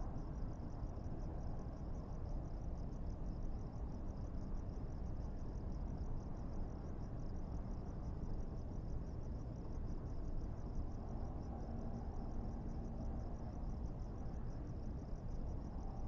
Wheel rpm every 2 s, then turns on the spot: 0, 0, 0, 0, 0, 0, 0, 0.
none